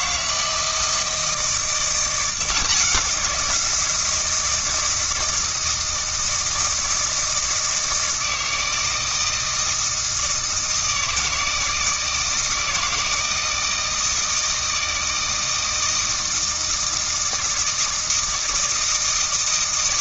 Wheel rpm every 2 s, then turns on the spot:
160, 180, 160, 160, 160, 160, 160, 160, 160, 160.
none